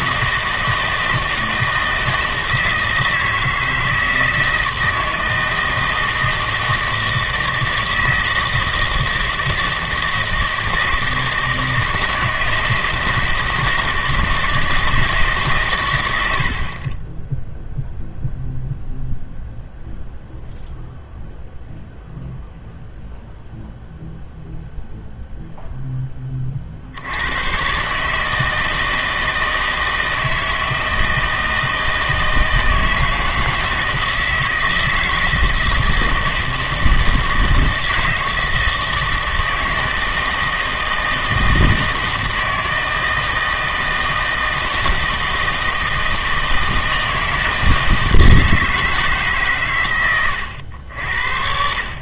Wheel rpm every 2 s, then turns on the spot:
160, 160, 160, 160, 160, 160, 160, 160, 40, 0, 0, 0, 0, 60, 160, 160, 160, 160, 160, 160, 160, 160, 170, 160, 160, 80.
none